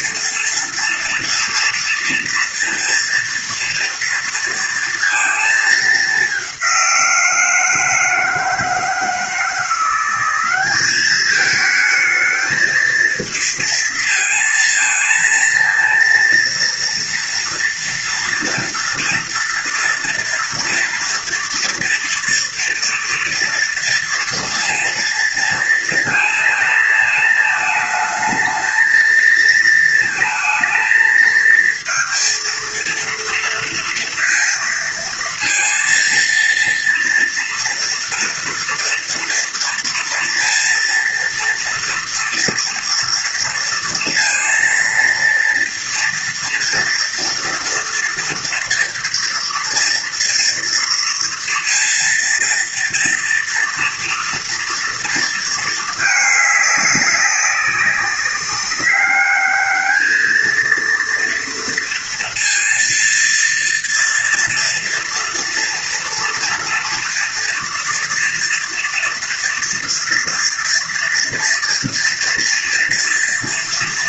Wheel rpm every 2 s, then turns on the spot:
230, 240, 230, 190, 160, 200, 220, 230, 230, 240, 230, 240, 230, 230, 220, 220, 230, 230, 230, 240, 230, 230, 230, 230, 230, 230, 230, 230, 210, 200, 220, 230, 230, 230, 230, 230, 230.
none